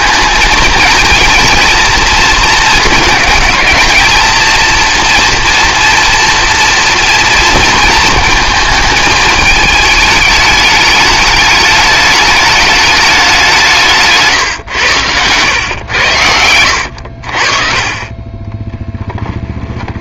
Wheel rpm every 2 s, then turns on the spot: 220, 220, 230, 230, 220, 210, 210, 120, 80, 10.
18-20